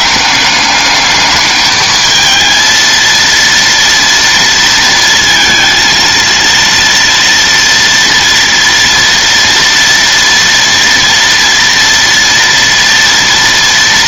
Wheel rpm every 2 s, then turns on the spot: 210, 220, 230, 230, 230, 230, 230.
none